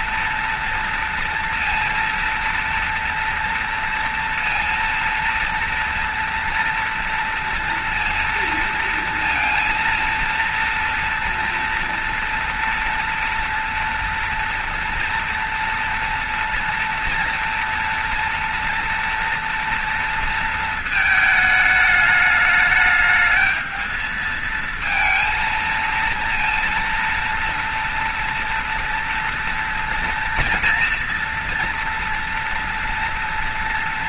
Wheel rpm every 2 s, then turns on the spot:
230, 230, 230, 230, 230, 230, 230, 230, 230, 230, 230, 210, 220, 230, 230, 230, 240.
none